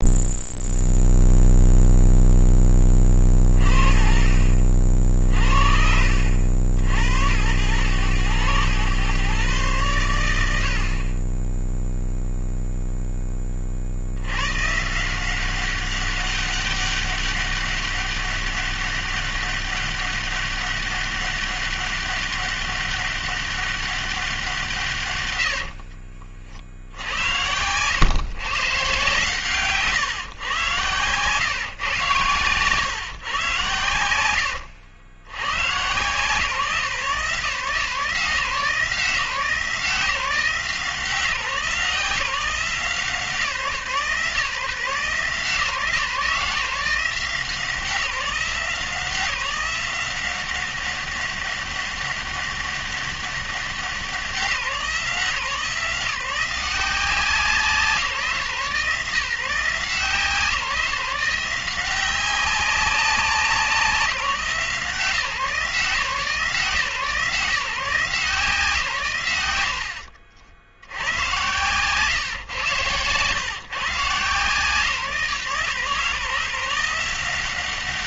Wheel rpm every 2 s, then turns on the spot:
0, 20, 50, 80, 100, 70, 0, 140, 200, 200, 200, 200, 150, 70, 140, 120, 130, 90, 150, 150, 160, 170, 150, 160, 170, 190, 200, 160, 180, 150, 170, 190, 150, 150, 160, 90, 130, 150, 160.
none